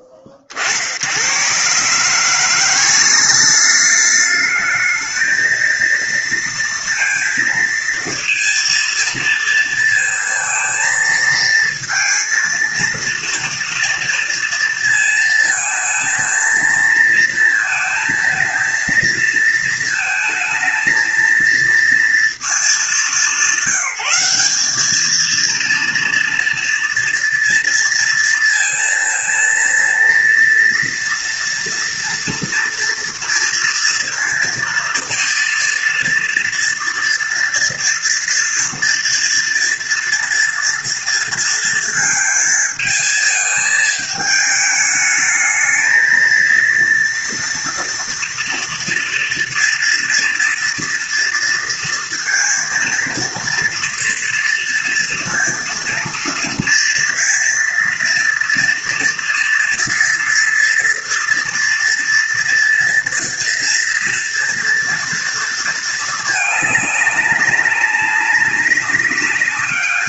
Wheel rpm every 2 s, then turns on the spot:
50, 170, 210, 230, 230, 230, 230, 230, 230, 230, 220, 210, 200, 230, 230, 230, 230, 230, 230, 230, 230, 220, 210, 230, 230, 230, 230, 230, 230, 230, 240, 230, 230, 210, 200.
none